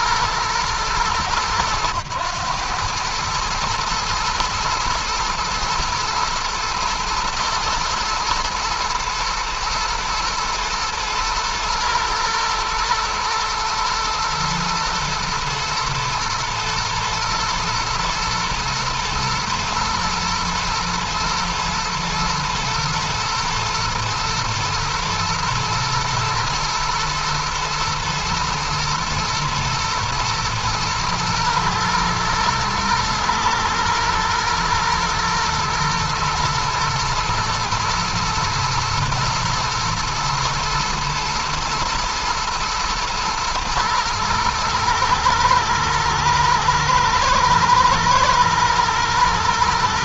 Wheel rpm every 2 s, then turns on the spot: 110, 110, 110, 110, 110, 110, 120, 110, 110, 120, 120, 110, 120, 110, 110, 110, 110, 110, 120, 120, 110, 110, 110, 110, 120.
none